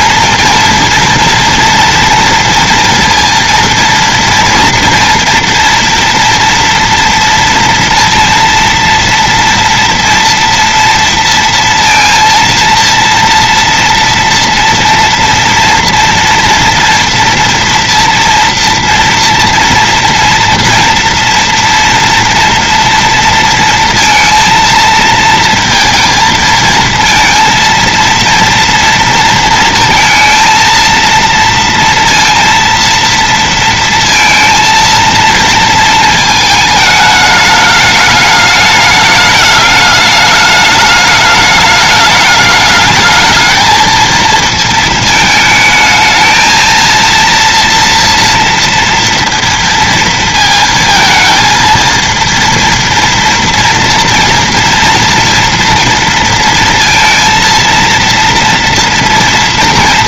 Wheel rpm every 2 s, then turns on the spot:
230, 230, 230, 230, 230, 230, 230, 230, 230, 230, 230, 230, 230, 230, 230, 230, 230, 230, 220, 210, 210, 220, 220, 230, 230, 230, 230, 230, 230, 230.
none